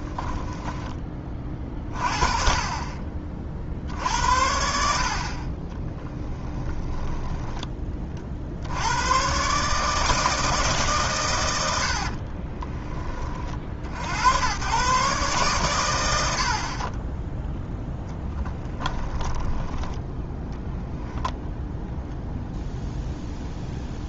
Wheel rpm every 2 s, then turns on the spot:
10, 30, 60, 10, 90, 140, 20, 120, 40, 10, 0, 0.
6-8 18-20